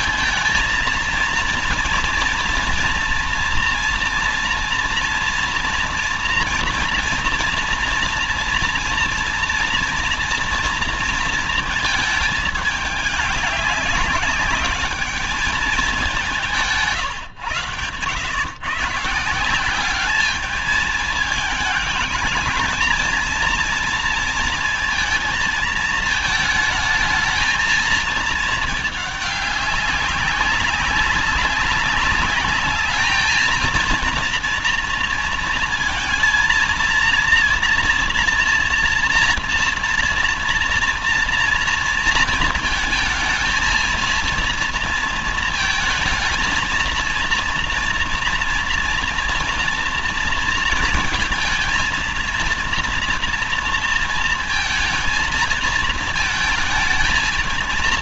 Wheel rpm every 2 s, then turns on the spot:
230, 240, 240, 230, 230, 230, 210, 200, 170, 120, 210, 220, 230, 220, 220, 200, 210, 230, 230, 230, 230, 230, 230, 230, 230, 230, 230, 230, 220.
none